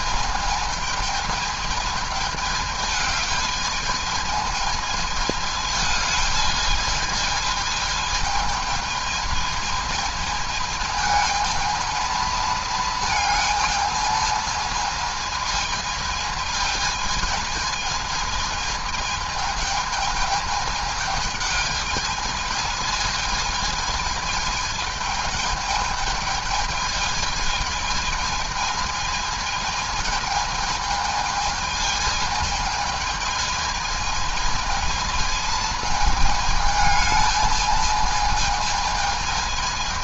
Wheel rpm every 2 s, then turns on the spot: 220, 210, 220, 210, 220, 220, 220, 220, 220, 220, 210, 220, 220, 220, 220, 220, 220, 220, 220, 220.
none